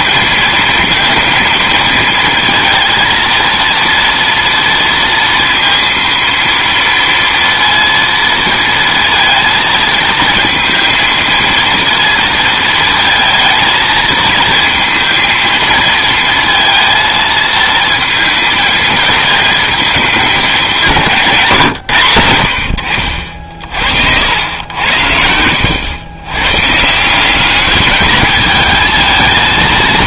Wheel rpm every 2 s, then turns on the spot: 220, 230, 230, 230, 230, 230, 230, 220, 230, 230, 200, 90, 90, 130, 220.
none